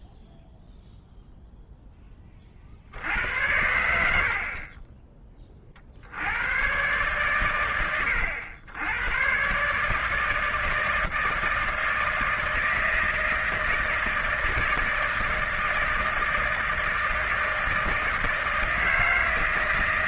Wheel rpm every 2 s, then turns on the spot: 0, 40, 50, 100, 90, 160, 160, 160, 160, 170.
none